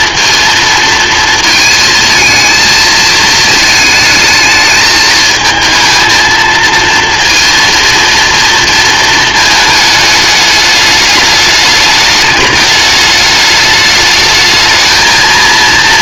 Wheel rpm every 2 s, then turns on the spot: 230, 220, 220, 230, 230, 210, 210, 220.
none